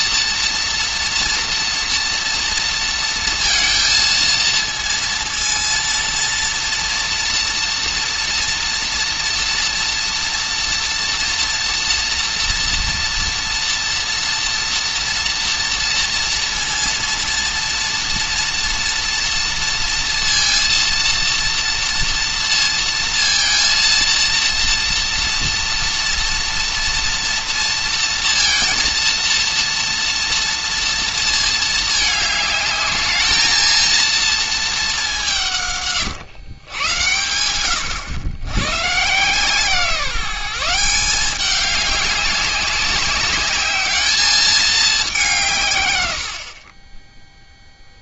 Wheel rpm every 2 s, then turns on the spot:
230, 230, 230, 230, 230, 230, 230, 230, 230, 230, 230, 230, 230, 240, 230, 230, 210, 210, 110, 120, 180, 200, 210, 30.
none